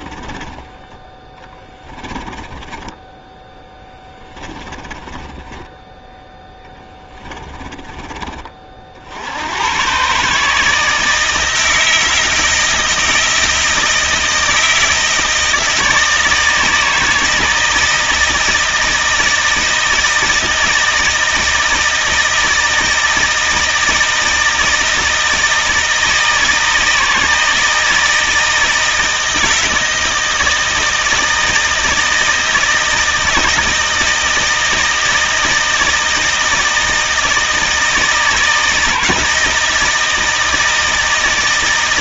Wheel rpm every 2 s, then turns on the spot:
10, 10, 20, 20, 50, 160, 160, 160, 160, 160, 160, 160, 160, 160, 160, 160, 160, 160, 160, 160, 160.
2-8